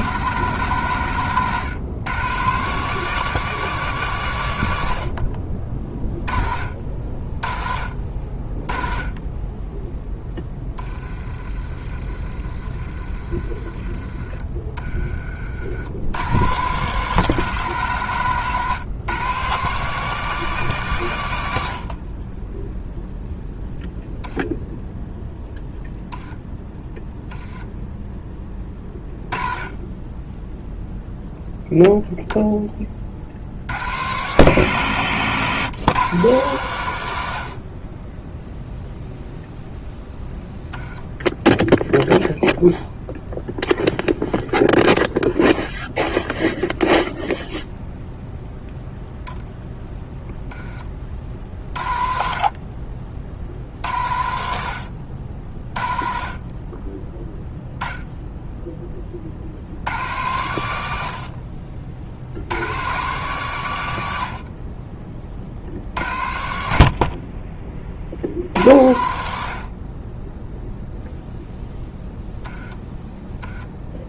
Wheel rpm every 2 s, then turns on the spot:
140, 150, 100, 40, 20, 10, 30, 20, 130, 140, 160, 10, 0, 10, 20, 0, 20, 120, 120, 0, 10, 0, 0, 0, 0, 10, 50, 80, 20, 10, 90, 100, 50, 50, 70, 0, 10.
none